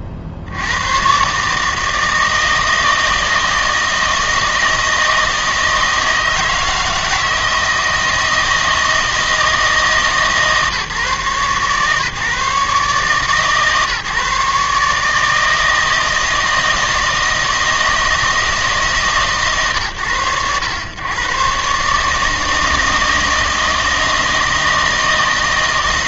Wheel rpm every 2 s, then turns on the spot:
80, 160, 160, 160, 160, 140, 130, 140, 160, 160, 90, 160, 160.
none